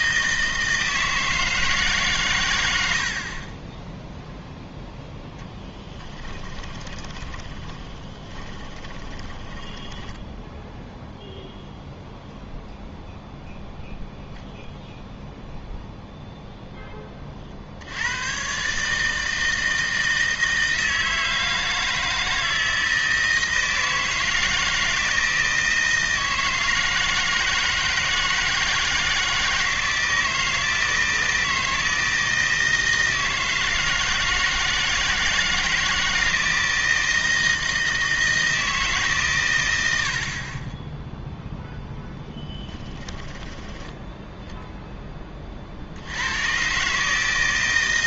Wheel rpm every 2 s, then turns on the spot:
160, 90, 0, 20, 20, 0, 0, 0, 0, 130, 160, 160, 160, 160, 160, 160, 160, 160, 160, 160, 20, 10, 0, 130.
6-10 42-44